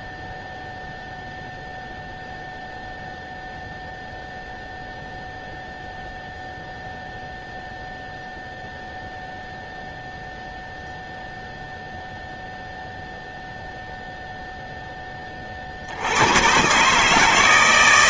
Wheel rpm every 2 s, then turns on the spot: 0, 0, 0, 0, 0, 0, 0, 0, 90.
none